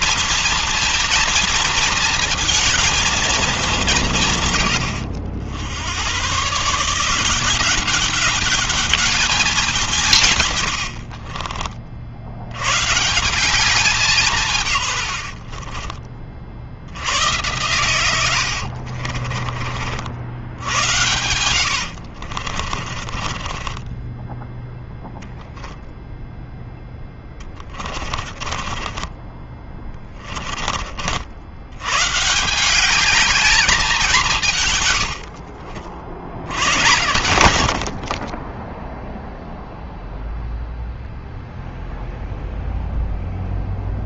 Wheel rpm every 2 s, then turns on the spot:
230, 230, 140, 120, 200, 140, 90, 160, 40, 80, 80, 50, 10, 0, 30, 30, 170, 180, 90, 40, 0, 0.
10-12 18-20 22-26 28-32 38-40